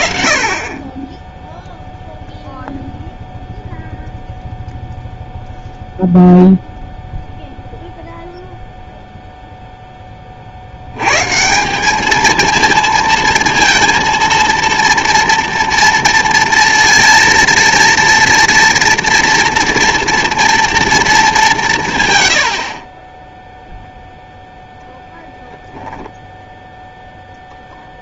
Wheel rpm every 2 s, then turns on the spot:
20, 0, 0, 0, 0, 90, 220, 230, 230, 230, 230, 60, 0, 0.
none